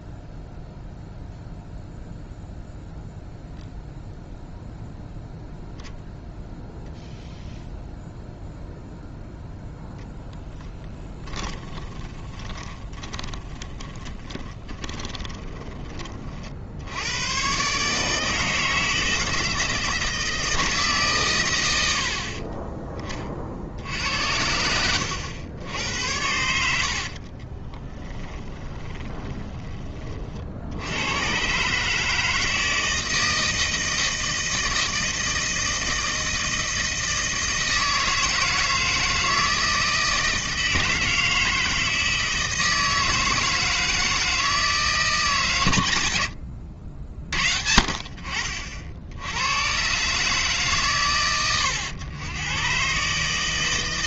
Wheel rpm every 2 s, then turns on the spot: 0, 0, 0, 0, 0, 20, 20, 20, 70, 160, 150, 20, 90, 70, 20, 80, 160, 160, 160, 160, 160, 160, 160, 110, 50, 140, 120.
10-16 24-30